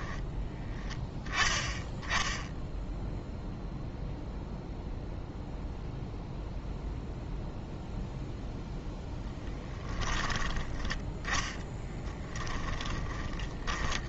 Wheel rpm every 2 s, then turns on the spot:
10, 0, 0, 0, 0, 10, 10.
12-14